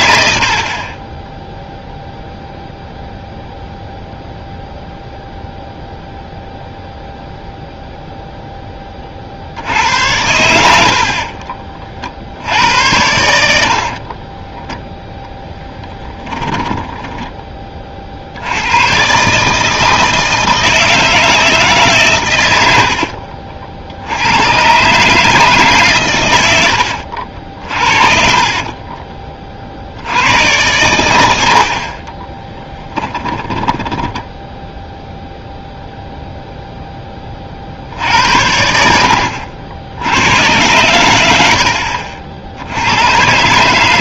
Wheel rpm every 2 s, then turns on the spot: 50, 0, 0, 0, 10, 80, 80, 10, 20, 90, 160, 80, 130, 90, 30, 100, 20, 0, 0, 70, 100, 80.
0-2 14-18 22-24 28-30 32-34